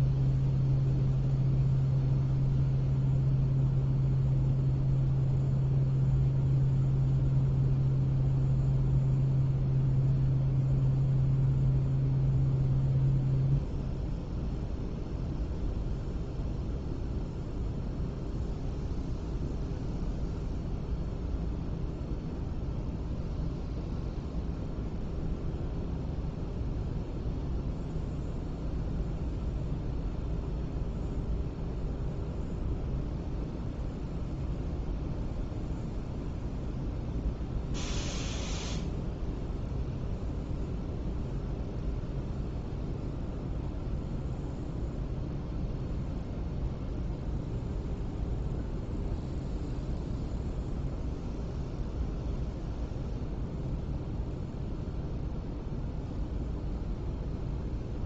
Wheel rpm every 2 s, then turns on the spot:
0, 0, 0, 0, 0, 0, 0, 0, 0, 0, 0, 0, 0, 0, 0, 0, 0, 0, 0, 0, 0, 0, 0, 0, 0, 0, 0, 0, 0.
none